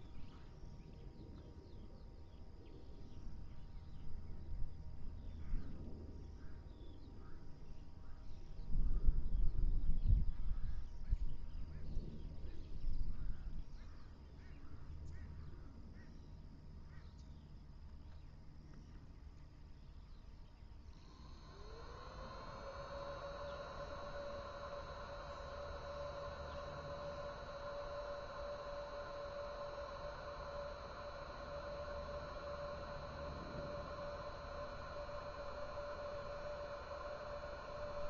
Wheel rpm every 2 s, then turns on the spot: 0, 0, 0, 0, 0, 0, 0, 0, 0, 0, 0, 0, 0, 0, 0, 0, 0, 0, 0.
none